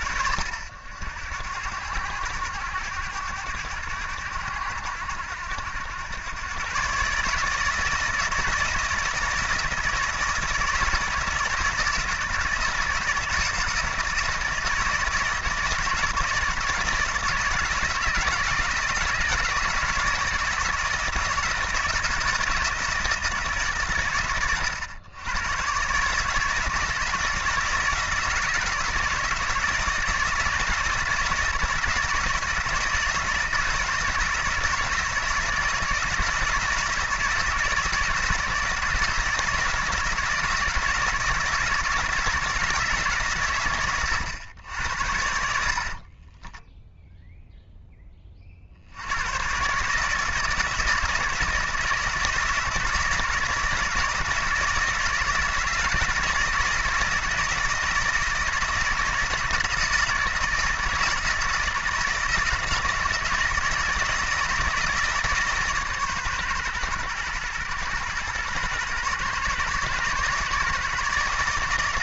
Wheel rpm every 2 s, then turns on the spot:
80, 100, 90, 140, 170, 160, 160, 160, 160, 160, 170, 170, 100, 160, 160, 160, 160, 160, 160, 160, 160, 150, 90, 0, 70, 160, 170, 160, 160, 170, 160, 170, 160, 120, 130, 150.
none